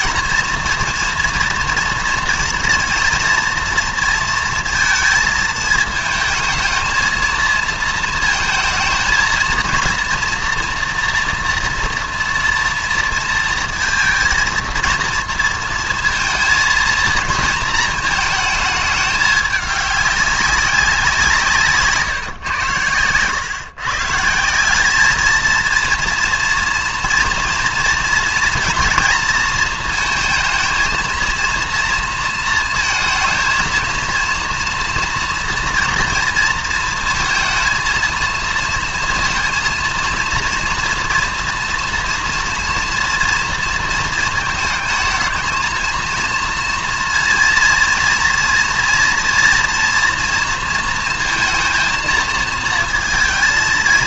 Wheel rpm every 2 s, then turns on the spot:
230, 230, 230, 220, 220, 230, 230, 230, 230, 210, 190, 110, 190, 230, 240, 230, 230, 230, 230, 230, 230, 230, 220, 230, 240, 230, 230.
none